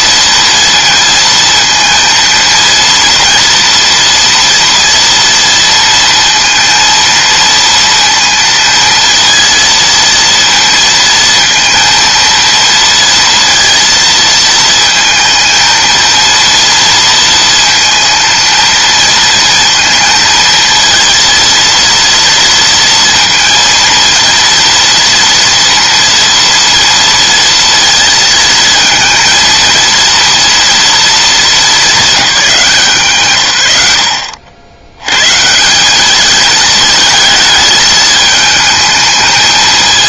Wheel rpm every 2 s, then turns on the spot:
230, 230, 230, 230, 230, 230, 230, 220, 230, 230, 230, 230, 230, 230, 230, 230, 160, 80, 220, 220.
none